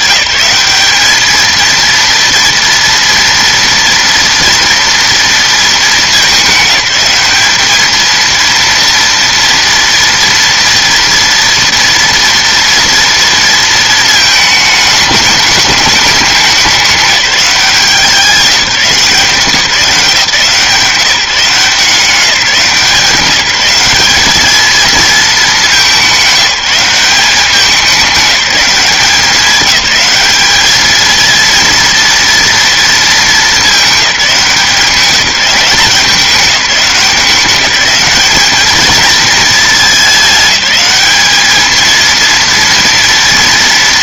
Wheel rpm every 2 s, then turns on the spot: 210, 240, 230, 210, 230, 230, 230, 210, 200, 190, 170, 180, 220, 190, 190, 210, 230, 190, 190, 210, 210, 230.
none